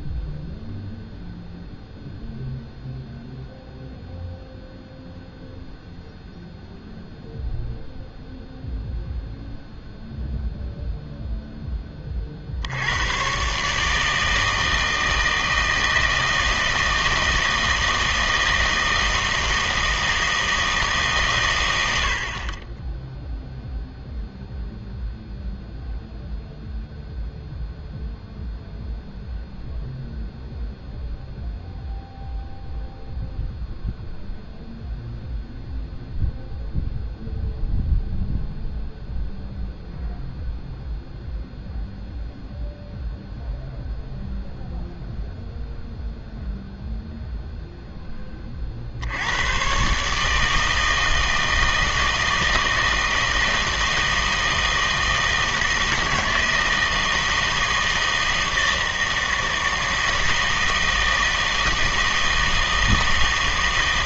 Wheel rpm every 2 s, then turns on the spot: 0, 0, 0, 0, 0, 0, 60, 160, 160, 160, 160, 20, 0, 0, 0, 0, 0, 0, 0, 0, 0, 0, 0, 0, 40, 160, 160, 160, 160, 160, 160, 160.
none